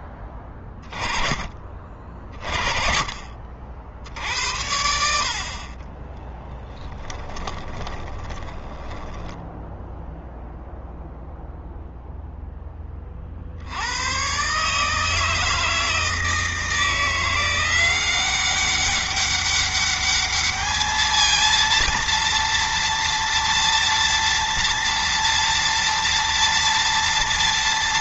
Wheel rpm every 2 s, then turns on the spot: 20, 30, 70, 10, 10, 0, 10, 140, 160, 190, 220, 230, 230, 230.
6-10